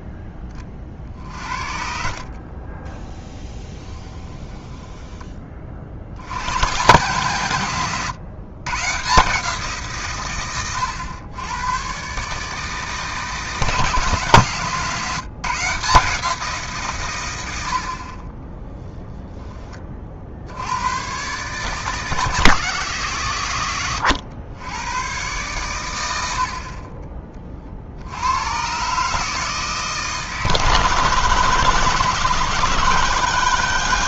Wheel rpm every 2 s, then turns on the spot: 60, 30, 10, 110, 130, 110, 160, 150, 150, 10, 90, 150, 100, 40, 130, 160, 160.
2-6 18-20